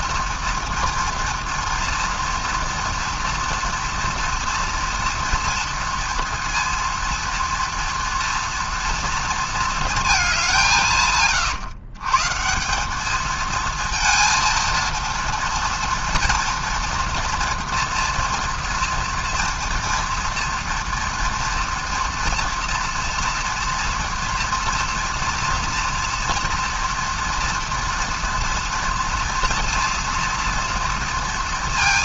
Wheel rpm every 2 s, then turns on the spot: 230, 230, 230, 230, 230, 180, 170, 230, 240, 230, 230, 240, 230, 230, 230, 230.
none